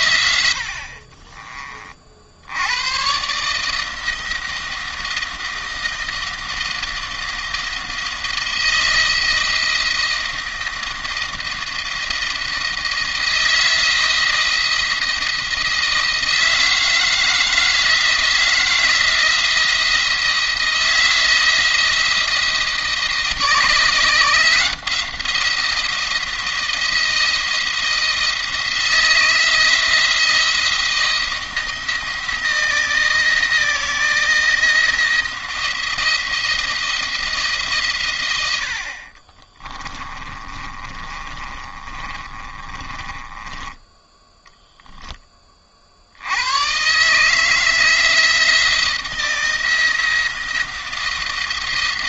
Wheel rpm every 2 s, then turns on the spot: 50, 100, 160, 170, 170, 170, 170, 170, 160, 160, 170, 170, 170, 170, 170, 170, 170, 170, 170, 70, 40, 30, 10, 130, 170, 170.
0-2 38-44